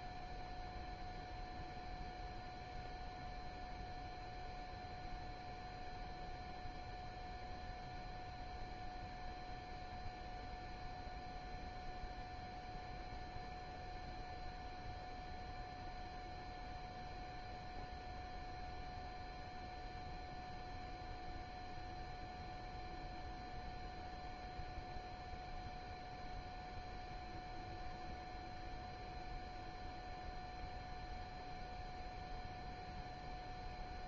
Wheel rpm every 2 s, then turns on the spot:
0, 0, 0, 0, 0, 0, 0, 0, 0, 0, 0, 0, 0, 0, 0, 0, 0.
none